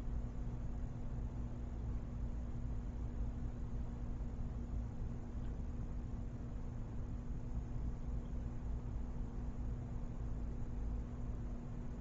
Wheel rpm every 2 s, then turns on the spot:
0, 0, 0, 0, 0, 0.
none